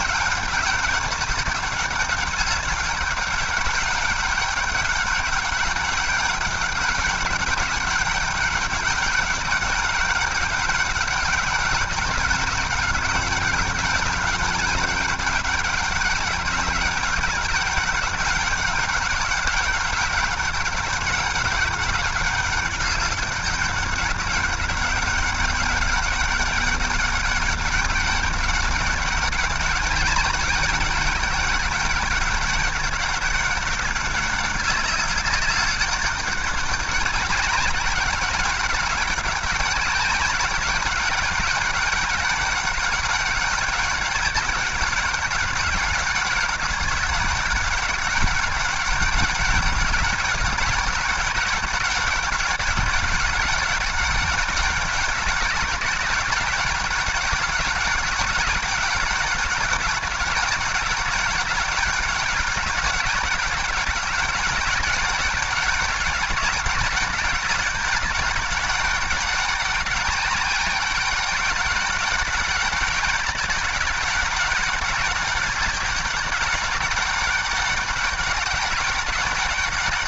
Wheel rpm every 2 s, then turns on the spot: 200, 200, 200, 200, 200, 200, 190, 190, 190, 190, 200, 200, 200, 200, 200, 200, 200, 200, 190, 200, 200, 200, 200, 190, 200, 190, 190, 190, 190, 200, 190, 190, 200, 200, 200, 200, 200, 200, 200, 200.
none